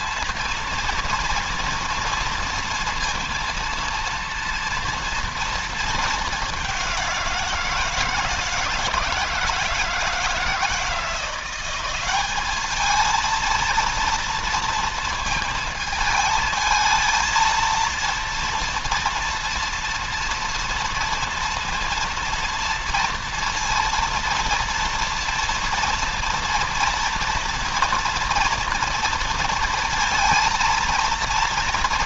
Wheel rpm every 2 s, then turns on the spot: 230, 230, 230, 180, 160, 170, 220, 230, 220, 230, 230, 230, 230, 230, 230, 230.
none